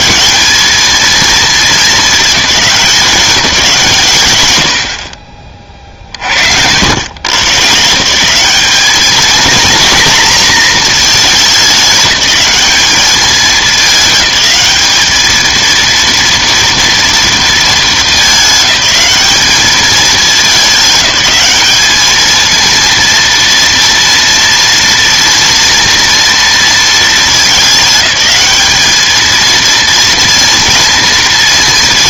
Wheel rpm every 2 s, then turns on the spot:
210, 190, 80, 70, 190, 230, 210, 210, 230, 210, 210, 230, 230, 230, 210, 230.
none